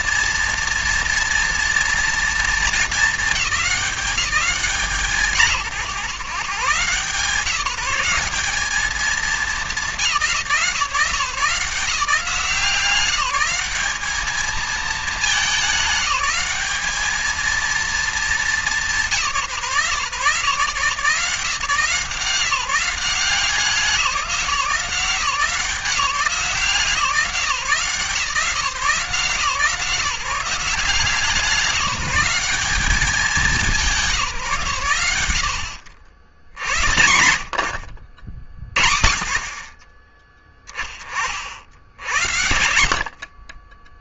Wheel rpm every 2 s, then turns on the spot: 230, 220, 140, 130, 210, 170, 170, 210, 200, 190, 150, 180, 180, 170, 170, 180, 210, 130, 100, 60, 20, 70.
none